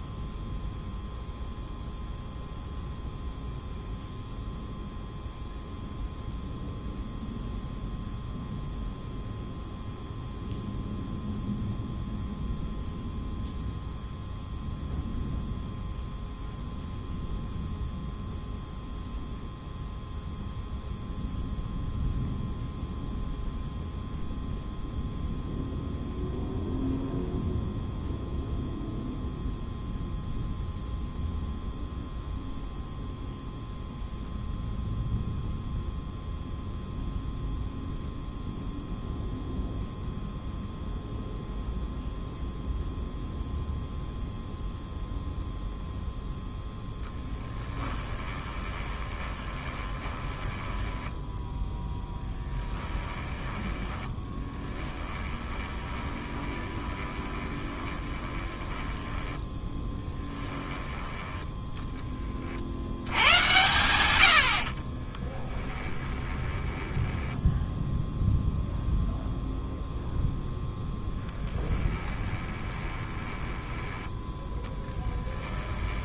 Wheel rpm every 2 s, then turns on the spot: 0, 0, 0, 0, 0, 0, 0, 0, 0, 0, 0, 0, 0, 0, 0, 0, 0, 0, 0, 0, 0, 0, 0, 0, 20, 10, 10, 10, 20, 10, 10, 40, 70, 20, 0, 0, 20, 10.
48-60 66-68 72-74